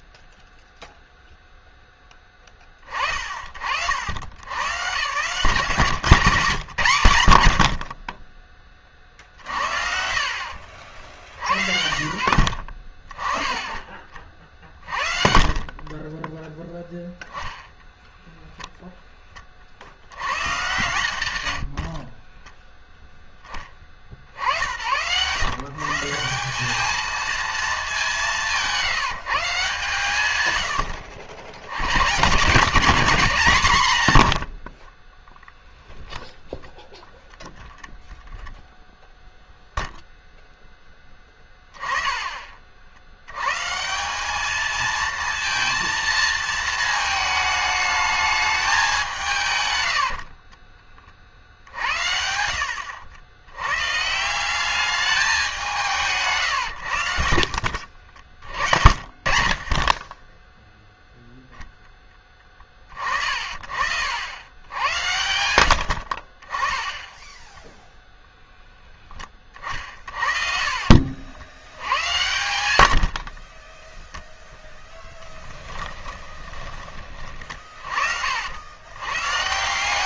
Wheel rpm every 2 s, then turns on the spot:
0, 20, 110, 140, 30, 70, 50, 40, 10, 0, 110, 0, 80, 210, 160, 100, 160, 40, 0, 0, 10, 60, 220, 220, 200, 30, 70, 200, 100, 70, 0, 40, 100, 10, 10, 50, 80, 10, 40, 100.
14-16 34-36 52-54 58-60 66-68 70-72 74-76